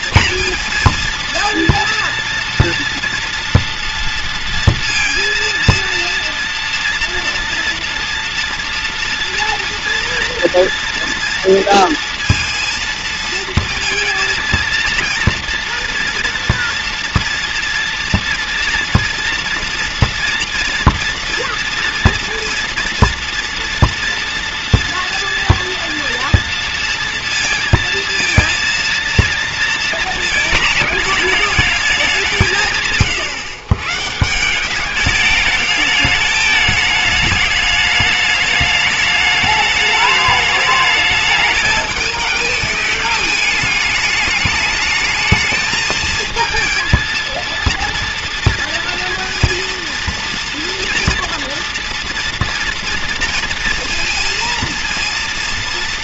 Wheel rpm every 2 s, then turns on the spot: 230, 230, 230, 230, 240, 230, 230, 230, 230, 230, 230, 230, 230, 240, 230, 220, 150, 190, 210, 210, 210, 210, 210, 230, 230, 230, 230, 230.
none